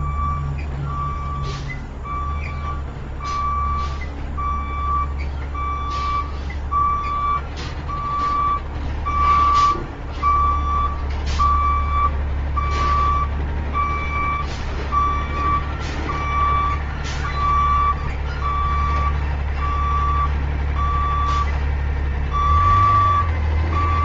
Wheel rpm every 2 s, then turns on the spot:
0, 0, 0, 0, 0, 0, 0, 0, 0, 0, 0, 0.
none